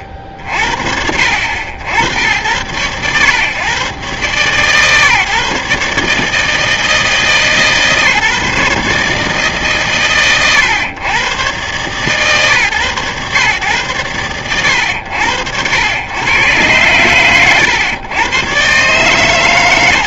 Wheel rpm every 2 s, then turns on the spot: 50, 90, 140, 150, 150, 110, 130, 90, 110, 110.
none